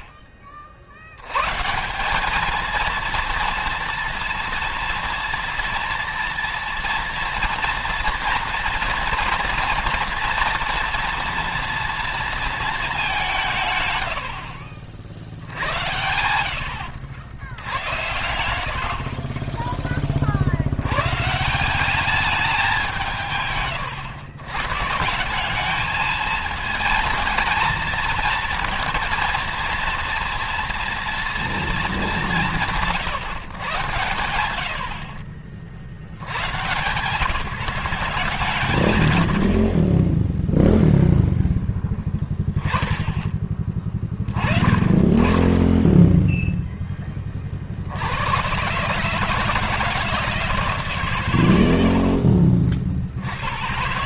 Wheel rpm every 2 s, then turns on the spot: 80, 230, 230, 230, 240, 230, 210, 60, 90, 60, 100, 180, 150, 220, 230, 240, 170, 70, 130, 110, 0, 10, 30, 10, 140, 140, 60.
16-18